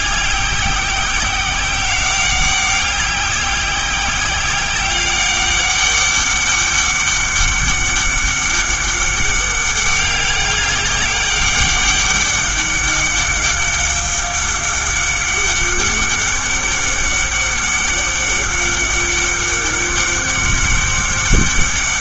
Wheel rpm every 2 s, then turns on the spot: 180, 200, 190, 200, 200, 200, 200, 200, 200, 200, 200.
none